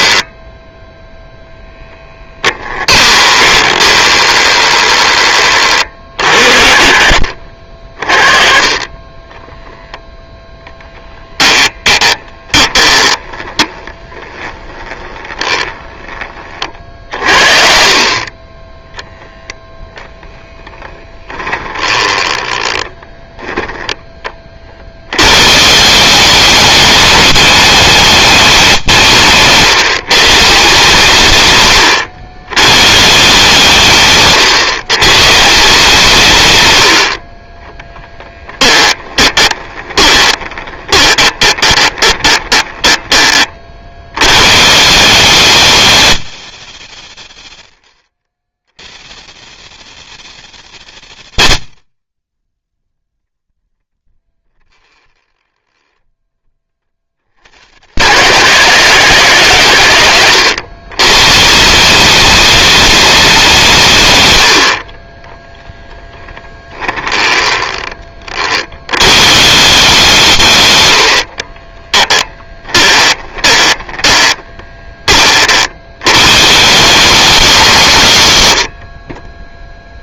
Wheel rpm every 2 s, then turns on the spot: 0, 20, 20, 40, 10, 10, 20, 10, 40, 0, 10, 10, 80, 210, 160, 140, 140, 120, 70, 10, 20, 10, 180, 150, 130, 160, 0, 20, 40, 120, 120, 210, 30, 10, 100, 90, 10, 30, 170, 30.
2-6 10-14 38-42 54-56 66-68 70-74